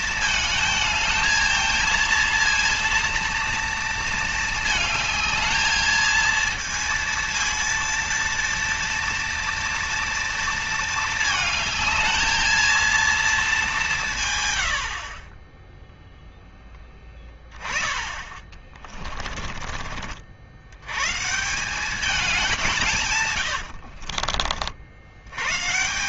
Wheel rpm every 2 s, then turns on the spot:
220, 230, 220, 230, 230, 230, 220, 110, 0, 20, 80, 200, 60.
18-20